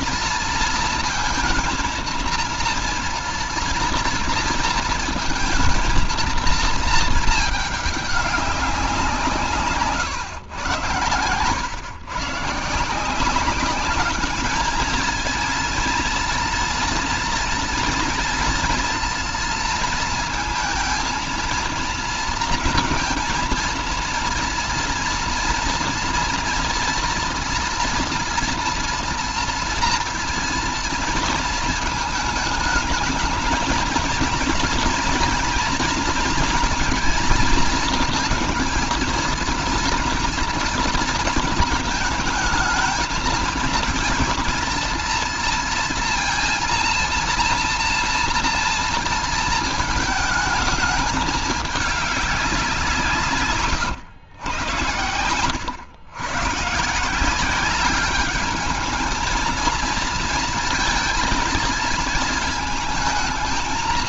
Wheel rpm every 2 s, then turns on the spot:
230, 230, 230, 220, 180, 110, 150, 210, 230, 230, 230, 230, 230, 230, 230, 230, 220, 230, 230, 240, 230, 220, 230, 240, 230, 210, 170, 110, 150, 210, 230, 220.
none